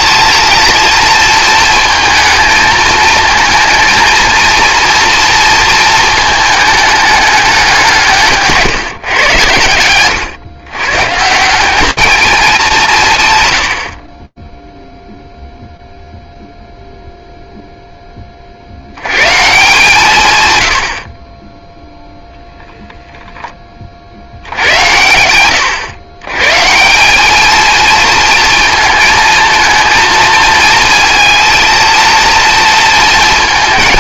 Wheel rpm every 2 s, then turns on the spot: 230, 220, 230, 210, 140, 120, 200, 0, 0, 100, 50, 10, 100, 210, 220, 230, 230.
none